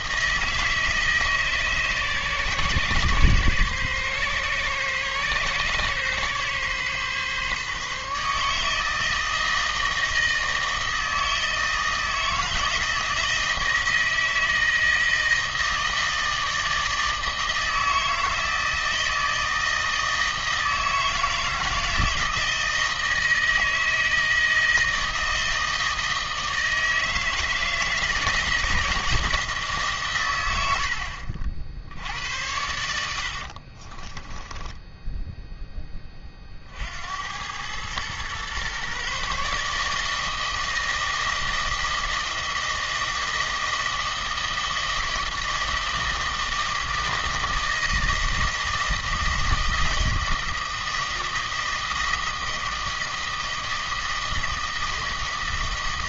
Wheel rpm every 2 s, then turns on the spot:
160, 140, 130, 140, 150, 160, 160, 160, 160, 160, 160, 160, 160, 160, 160, 90, 80, 10, 50, 120, 160, 160, 160, 160, 160, 160, 160, 160.
34-36